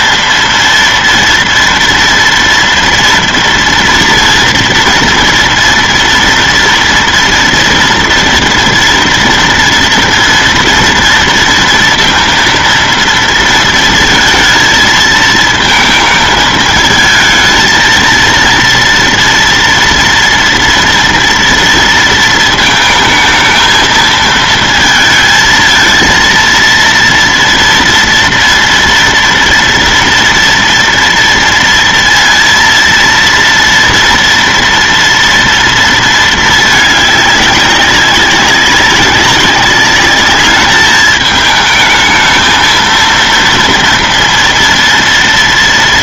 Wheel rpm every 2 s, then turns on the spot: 230, 240, 230, 230, 230, 230, 230, 230, 220, 230, 240, 220, 220, 230, 230, 230, 230, 230, 220, 200, 210, 220, 230.
none